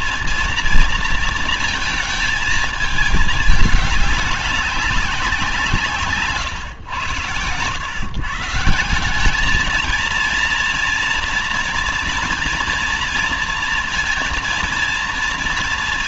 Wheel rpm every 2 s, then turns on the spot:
230, 220, 200, 120, 160, 230, 230, 230.
none